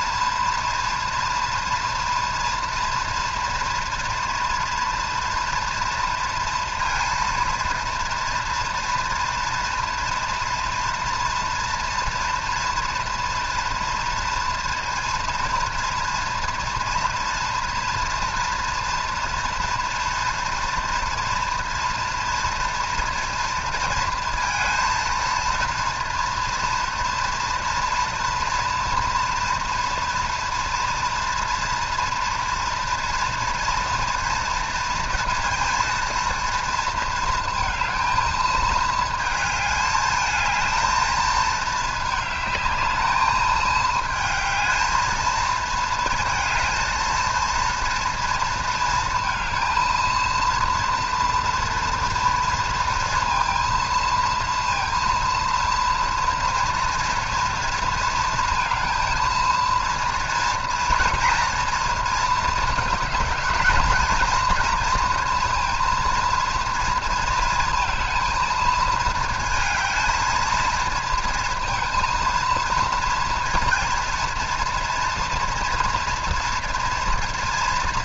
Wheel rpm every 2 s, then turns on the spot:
230, 230, 230, 230, 230, 230, 230, 240, 240, 230, 230, 230, 230, 230, 230, 230, 230, 230, 230, 220, 220, 220, 220, 230, 230, 230, 230, 230, 230, 230, 230, 230, 240, 230, 230, 230, 230, 230, 230.
none